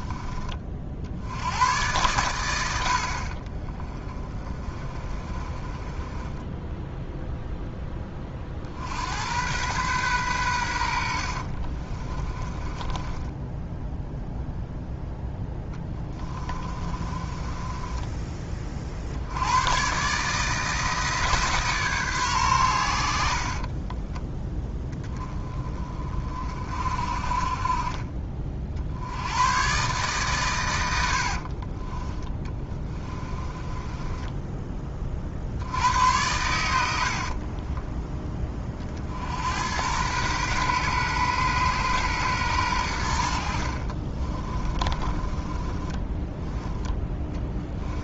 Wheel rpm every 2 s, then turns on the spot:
50, 80, 30, 10, 60, 80, 20, 0, 30, 50, 160, 100, 10, 40, 60, 90, 20, 20, 80, 30, 120, 100, 20, 10.
4-8 12-14 16-18 32-34 44-46